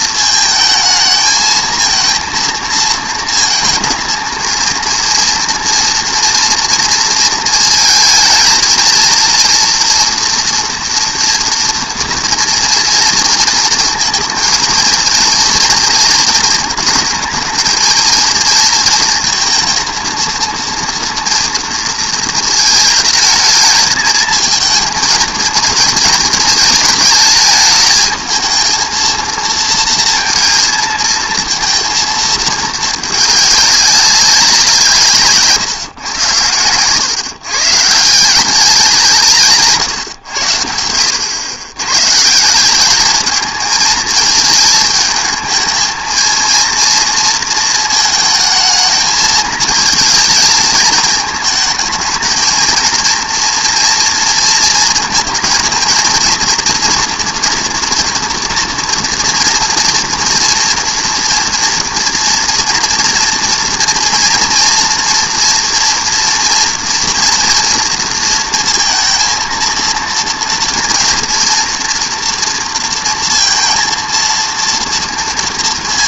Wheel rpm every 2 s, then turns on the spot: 220, 230, 230, 230, 230, 230, 230, 230, 220, 230, 230, 220, 230, 220, 220, 230, 220, 170, 110, 200, 90, 190, 220, 230, 220, 220, 230, 230, 230, 230, 230, 230, 240, 230, 220, 230, 230, 230.
none